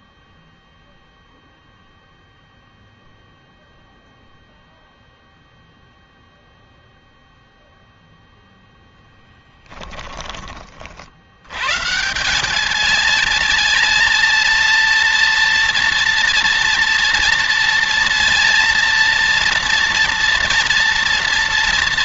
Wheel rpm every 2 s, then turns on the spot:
0, 0, 0, 0, 10, 40, 210, 230, 230, 230, 230.
none